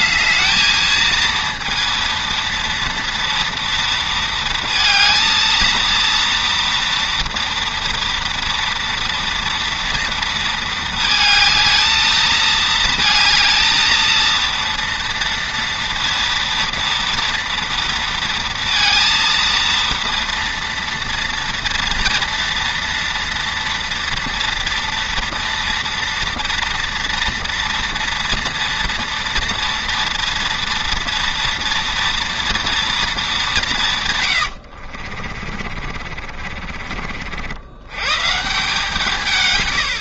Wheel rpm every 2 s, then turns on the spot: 220, 230, 230, 230, 230, 230, 220, 230, 230, 230, 230, 230, 240, 230, 240, 230, 230, 80, 40, 140.
34-38